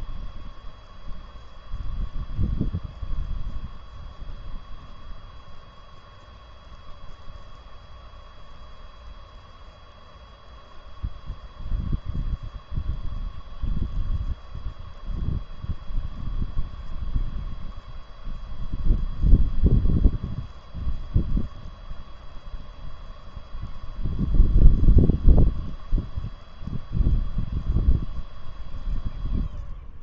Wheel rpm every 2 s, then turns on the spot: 0, 0, 0, 0, 0, 0, 0, 0, 0, 0, 0, 0, 0, 0, 0.
none